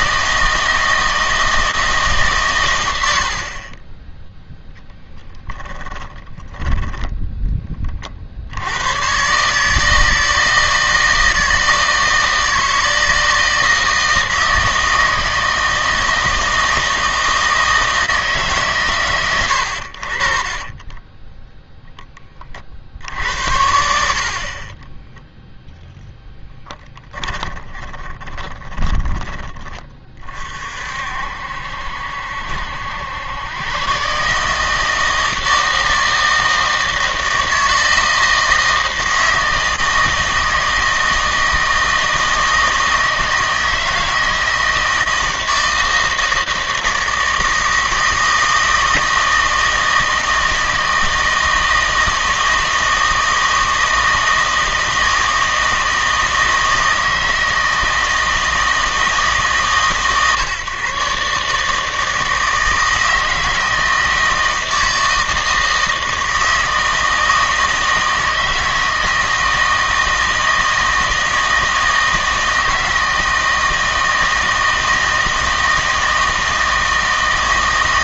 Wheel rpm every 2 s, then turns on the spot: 160, 110, 10, 10, 90, 160, 160, 160, 160, 130, 30, 50, 20, 10, 20, 50, 80, 160, 160, 160, 160, 160, 160, 160, 160, 160, 160, 160, 160, 160, 140, 160, 160, 160, 160, 160, 160, 160, 160.
6-8 20-22 24-30